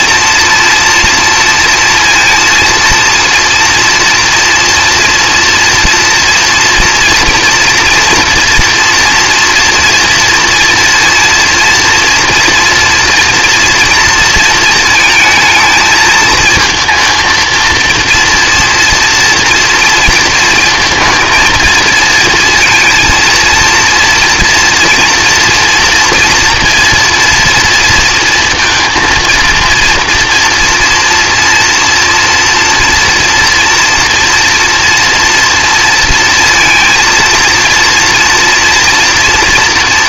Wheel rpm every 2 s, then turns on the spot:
230, 230, 230, 230, 230, 230, 230, 230, 230, 230, 230, 230, 230, 230, 230, 230, 240, 240, 230, 230.
none